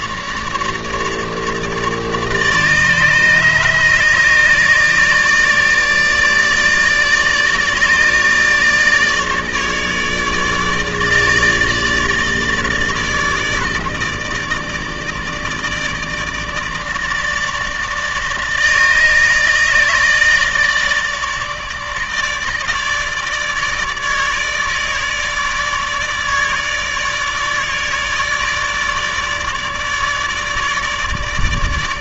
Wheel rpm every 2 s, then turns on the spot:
150, 150, 150, 150, 150, 150, 150, 150, 150, 150, 150, 150, 160, 150, 150, 150.
none